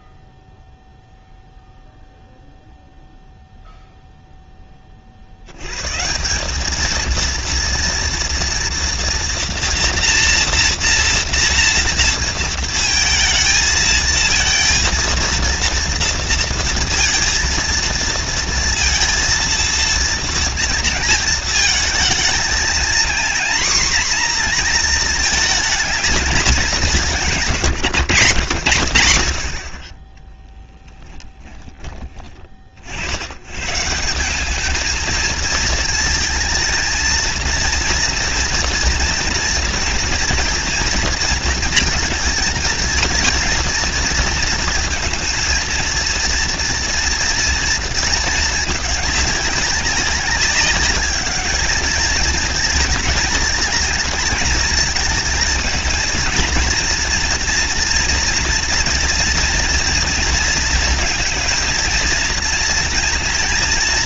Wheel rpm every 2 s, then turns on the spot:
0, 0, 0, 140, 230, 230, 230, 230, 230, 230, 230, 220, 240, 220, 120, 40, 30, 190, 230, 230, 230, 220, 230, 230, 220, 200, 220, 220, 230, 230, 230, 230.
none